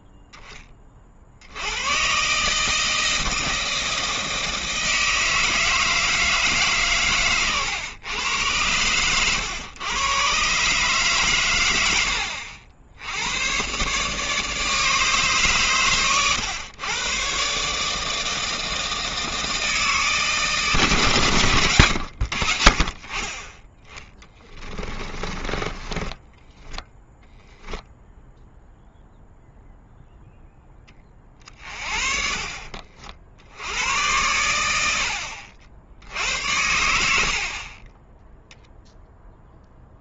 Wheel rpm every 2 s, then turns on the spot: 10, 150, 160, 150, 100, 130, 80, 150, 110, 160, 150, 70, 20, 10, 0, 10, 50, 80, 90, 0.
24-28 32-34